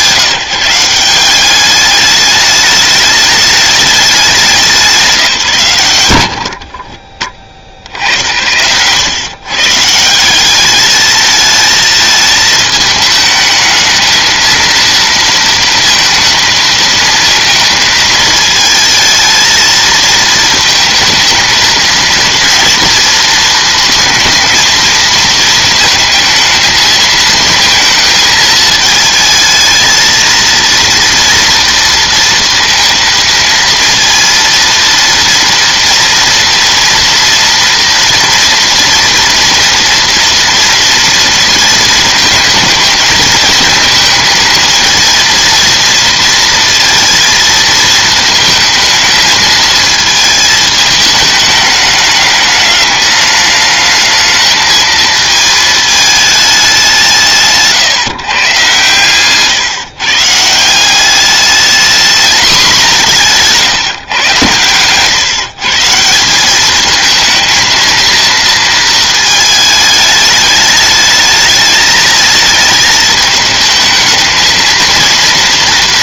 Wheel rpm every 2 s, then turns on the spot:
180, 210, 190, 30, 90, 200, 220, 230, 220, 220, 220, 230, 220, 220, 220, 230, 230, 230, 230, 240, 230, 220, 220, 230, 220, 220, 210, 220, 200, 130, 170, 210, 110, 210, 230, 210, 220, 230.
none